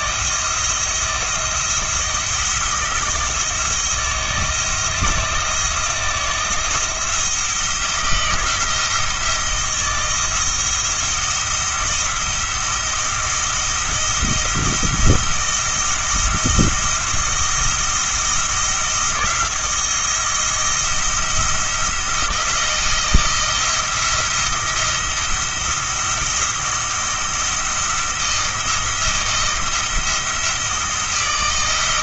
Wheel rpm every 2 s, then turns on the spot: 160, 170, 170, 160, 170, 170, 170, 170, 170, 170, 170, 160, 170, 170, 170, 160.
none